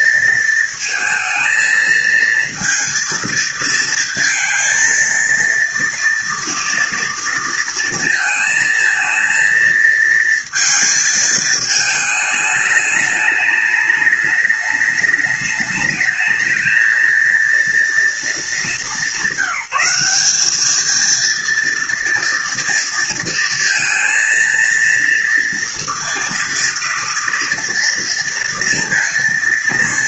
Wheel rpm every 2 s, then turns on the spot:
220, 230, 230, 230, 220, 230, 210, 210, 220, 210, 210, 230, 230, 230, 230.
none